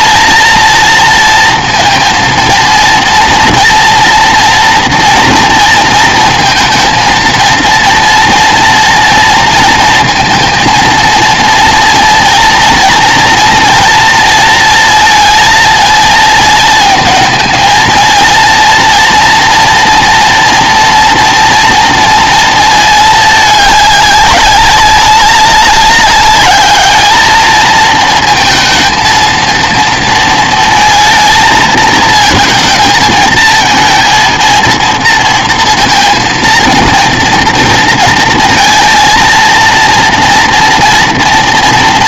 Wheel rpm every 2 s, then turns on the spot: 230, 230, 230, 230, 230, 230, 230, 230, 220, 230, 230, 220, 200, 210, 230, 220, 220, 220, 230, 230, 230.
none